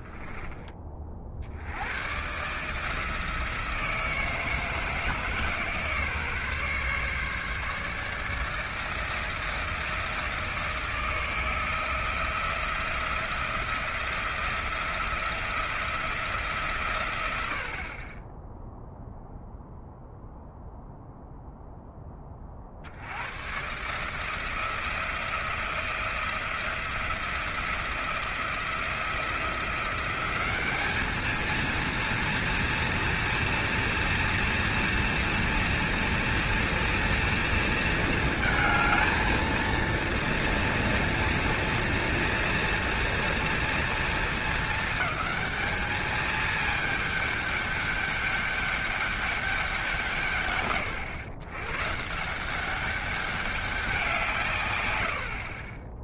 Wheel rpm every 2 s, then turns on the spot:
30, 160, 160, 140, 160, 160, 170, 170, 130, 0, 0, 80, 170, 170, 170, 210, 230, 230, 230, 220, 230, 230, 200, 210, 200, 120, 200, 100.
none